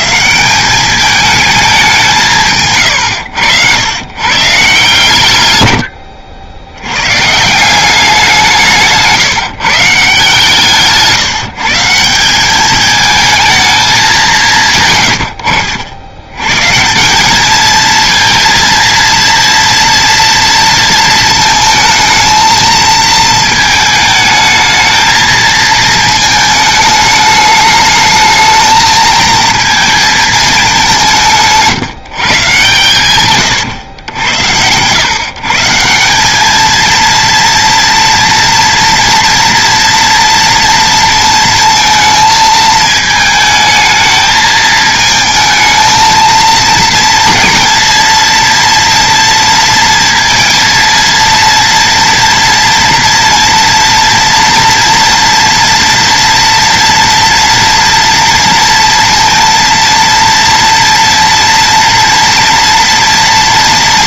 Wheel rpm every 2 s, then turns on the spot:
180, 140, 140, 80, 180, 150, 200, 150, 140, 230, 230, 220, 220, 220, 220, 210, 130, 90, 220, 230, 230, 220, 220, 230, 230, 230, 240, 230, 230, 230, 230, 230.
none